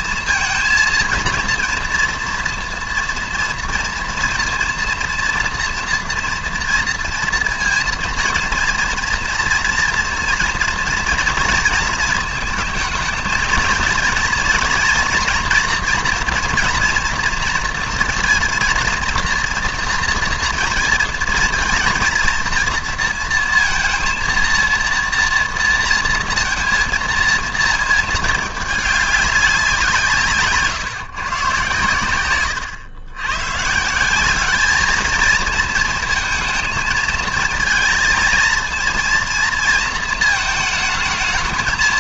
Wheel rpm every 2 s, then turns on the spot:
230, 230, 230, 230, 230, 230, 220, 230, 240, 230, 230, 230, 230, 230, 210, 140, 110, 210, 220, 230, 220.
none